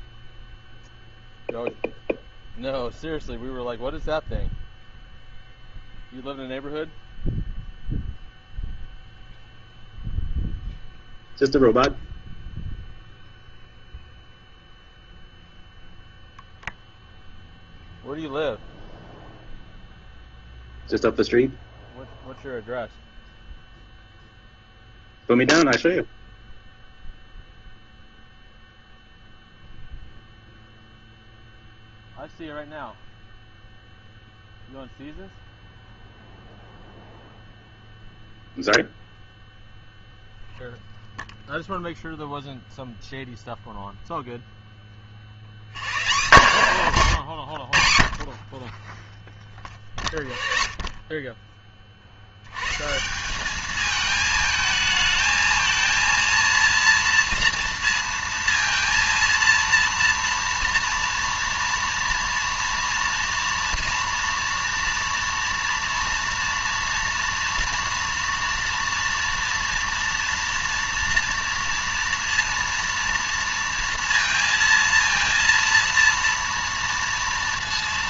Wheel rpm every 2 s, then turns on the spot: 0, 0, 0, 0, 0, 0, 0, 0, 0, 0, 0, 0, 0, 0, 0, 0, 0, 0, 0, 0, 0, 0, 20, 120, 20, 30, 130, 220, 230, 230, 240, 230, 230, 230, 230, 230, 230, 230, 230.
none